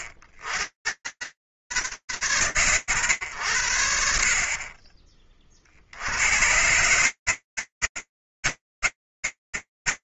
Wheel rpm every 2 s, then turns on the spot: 100, 60, 30, 120, 10.
none